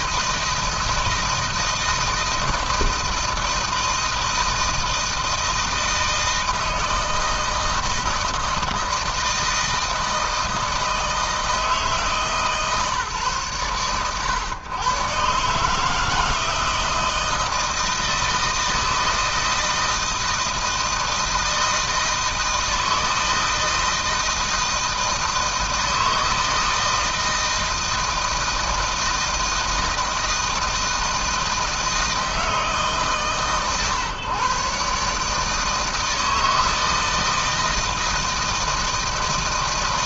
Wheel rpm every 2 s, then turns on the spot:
160, 160, 160, 160, 160, 160, 150, 120, 160, 160, 160, 160, 160, 160, 160, 160, 150, 140, 160, 160.
none